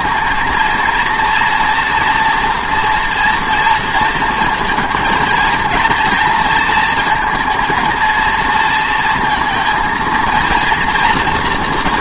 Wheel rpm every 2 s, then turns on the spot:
230, 240, 220, 230, 230, 230.
none